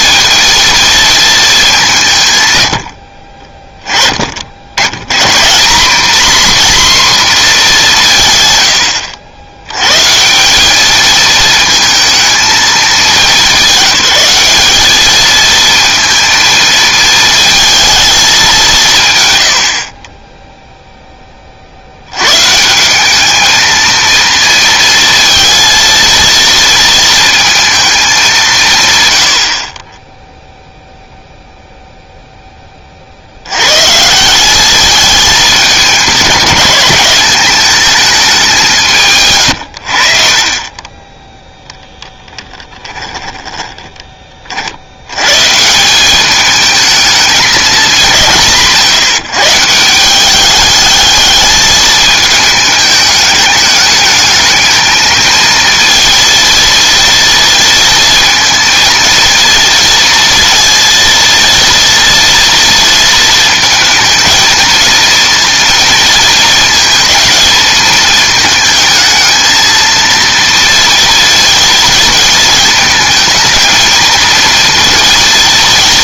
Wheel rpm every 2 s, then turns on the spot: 230, 100, 80, 260, 100, 190, 210, 200, 220, 170, 10, 180, 230, 230, 140, 0, 30, 200, 200, 170, 20, 10, 60, 210, 160, 210, 210, 220, 230, 230, 230, 230, 230, 220, 220, 230, 230, 230.
40-44